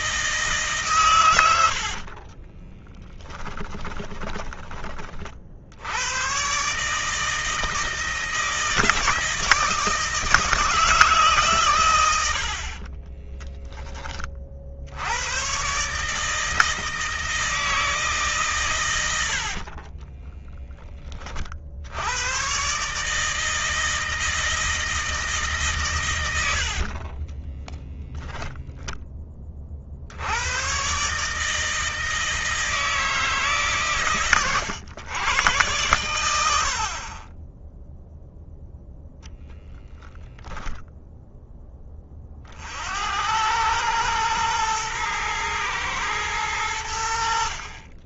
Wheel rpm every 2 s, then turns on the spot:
140, 20, 30, 140, 160, 160, 40, 70, 160, 120, 20, 140, 160, 70, 10, 120, 160, 110, 60, 0, 0, 60, 110, 90.
2-4 12-14 26-28